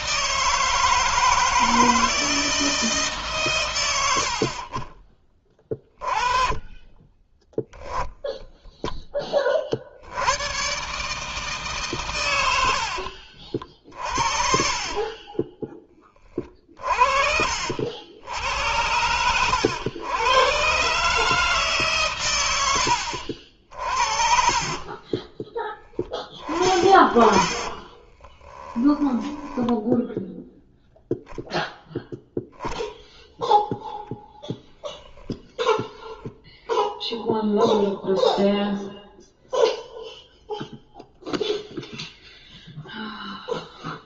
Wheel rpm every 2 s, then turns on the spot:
160, 150, 40, 20, 10, 140, 80, 30, 50, 80, 130, 90, 30, 40, 10, 0, 0, 0, 0, 0, 0, 0.
12-16 24-30